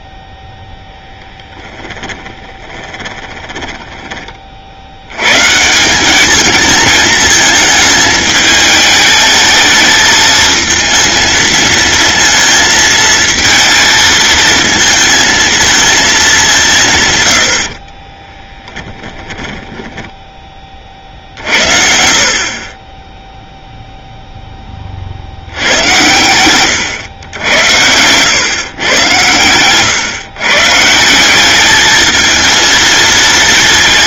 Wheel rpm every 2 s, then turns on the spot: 0, 20, 70, 220, 210, 220, 220, 220, 160, 10, 40, 30, 30, 110, 130, 150, 220.
2-4 18-20